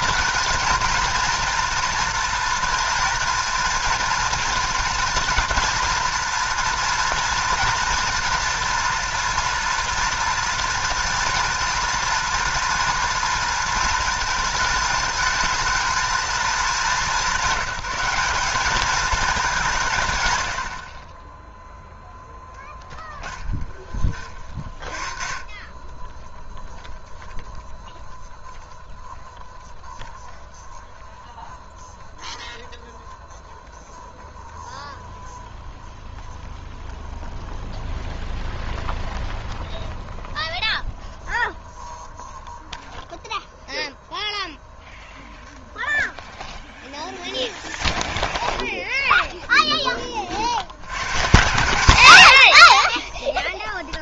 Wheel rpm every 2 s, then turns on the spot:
230, 230, 230, 230, 240, 230, 230, 220, 220, 200, 80, 10, 40, 0, 0, 0, 0, 0, 0, 0, 0, 0, 0, 10, 10, 80, 70.
22-24 48-50